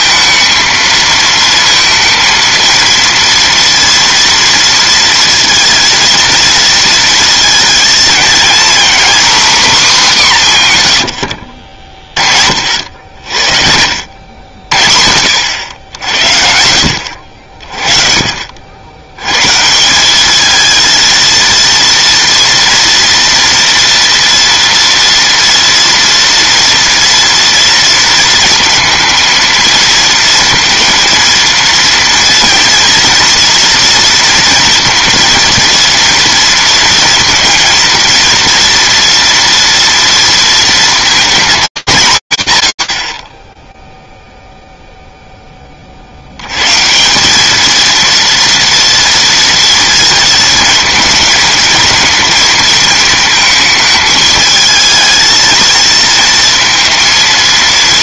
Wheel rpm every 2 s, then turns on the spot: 220, 230, 230, 230, 240, 170, 60, 60, 70, 60, 220, 230, 230, 230, 230, 230, 240, 230, 230, 240, 230, 150, 0, 110, 230, 230, 230, 220, 230.
none